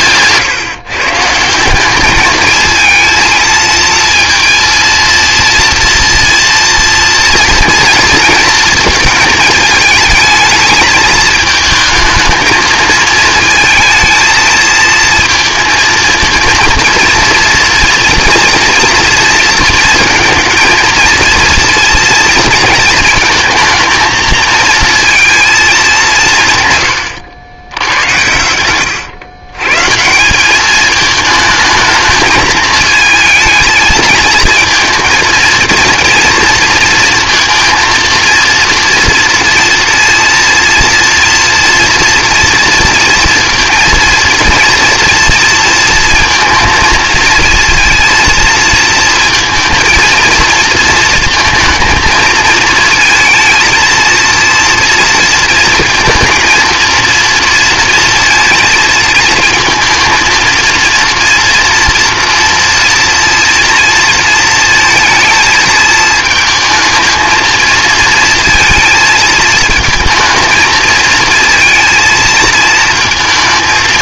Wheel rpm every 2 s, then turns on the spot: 150, 220, 230, 230, 220, 220, 220, 220, 230, 230, 230, 230, 230, 140, 110, 210, 220, 230, 230, 230, 230, 230, 230, 230, 230, 230, 220, 230, 230, 220, 230, 240, 230, 220, 230, 220, 220.
none